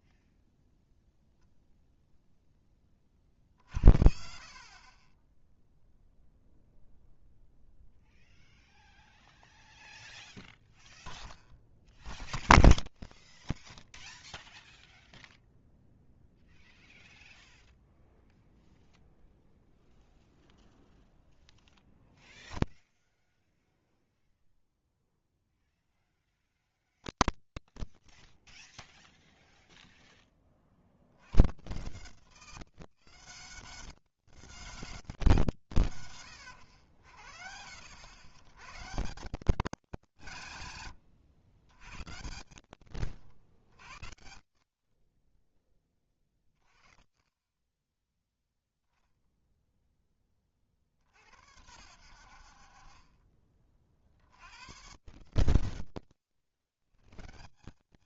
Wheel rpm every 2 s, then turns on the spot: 0, 10, 50, 0, 0, 0, 0, 0, 0, 0, 0, 0, 0, 0, 0, 40, 190, 210, 110, 120, 160, 100, 50, 20, 0, 40, 60, 100, 140.
none